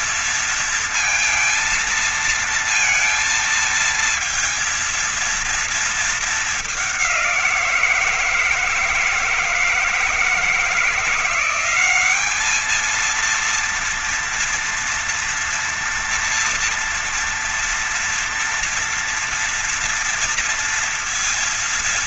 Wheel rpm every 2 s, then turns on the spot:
230, 230, 230, 220, 160, 160, 200, 230, 230, 230, 230.
none